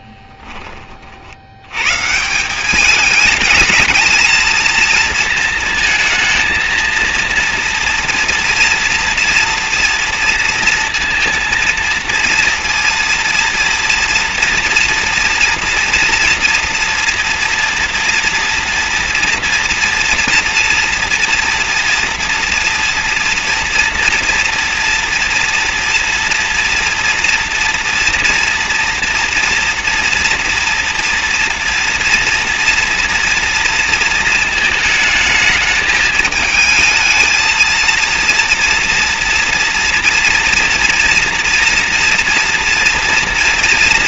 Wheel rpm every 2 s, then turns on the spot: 20, 180, 230, 220, 230, 230, 230, 230, 230, 240, 230, 230, 230, 230, 230, 230, 240, 220, 220, 230, 230, 230.
none